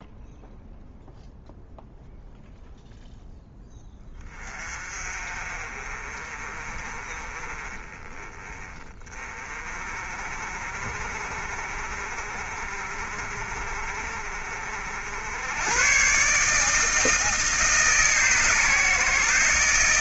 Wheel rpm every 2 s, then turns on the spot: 0, 0, 30, 30, 20, 40, 40, 60, 160, 140.
none